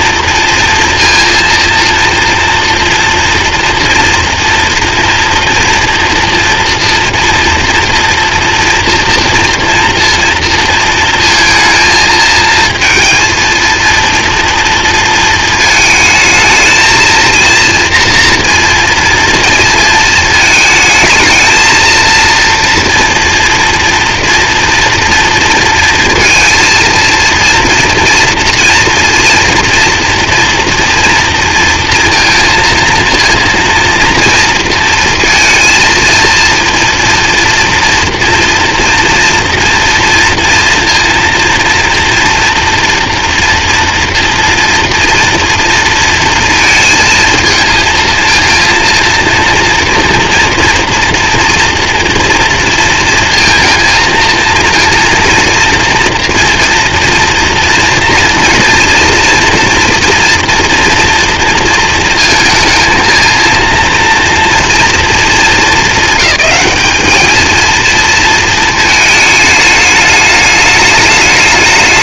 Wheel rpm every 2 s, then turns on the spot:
230, 230, 230, 230, 230, 230, 230, 230, 220, 230, 220, 230, 240, 230, 230, 230, 230, 230, 230, 230, 230, 240, 230, 230, 230, 240, 230, 230, 240, 240, 240, 230, 230, 210, 220, 210.
none